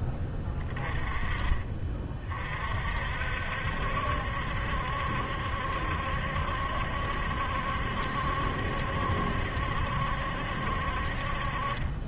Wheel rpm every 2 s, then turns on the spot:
20, 40, 70, 70, 70, 60.
none